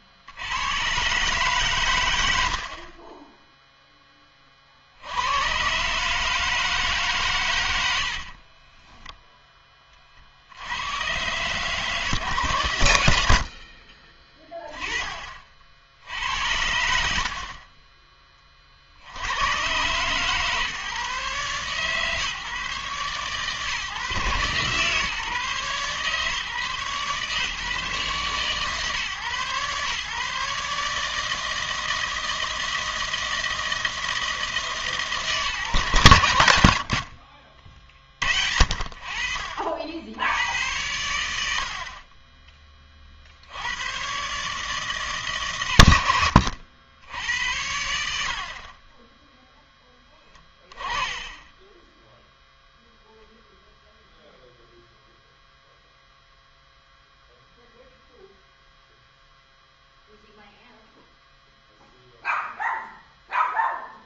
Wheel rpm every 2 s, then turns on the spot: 120, 40, 70, 150, 10, 100, 110, 20, 80, 50, 140, 130, 130, 140, 130, 150, 160, 150, 80, 60, 100, 30, 150, 80, 20, 20, 0, 0, 0, 0, 0, 0.
8-10